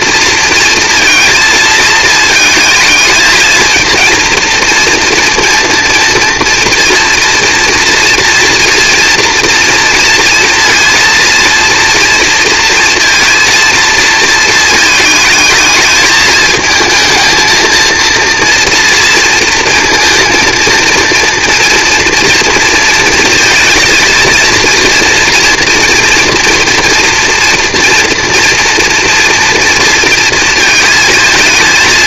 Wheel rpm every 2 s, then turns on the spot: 230, 220, 240, 230, 230, 230, 240, 220, 220, 230, 230, 230, 230, 230, 230, 220.
none